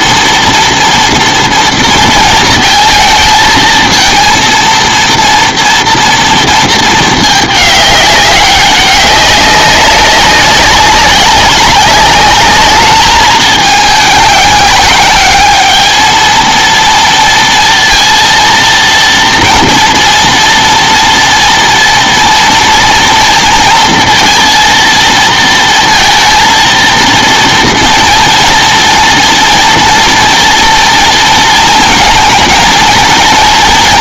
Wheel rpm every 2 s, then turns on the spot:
230, 220, 230, 230, 200, 190, 210, 200, 230, 230, 230, 230, 230, 230, 240, 230, 230.
none